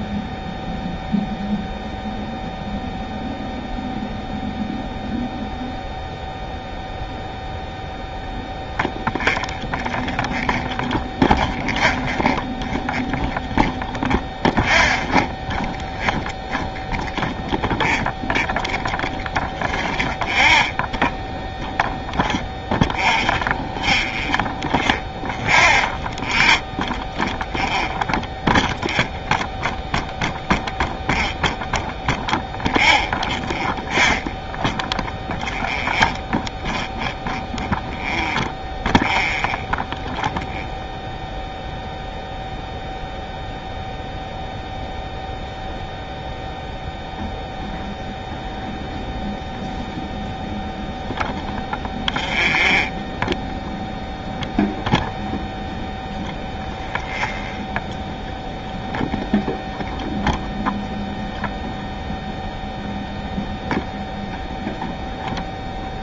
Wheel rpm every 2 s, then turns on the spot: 0, 0, 0, 0, 0, 0, 0, 0, 0, 0, 0, 0, 0, 0, 0, 0, 0, 0, 0, 0, 0, 0, 0, 0, 0, 0, 0, 0, 0, 0, 0, 0, 0.
none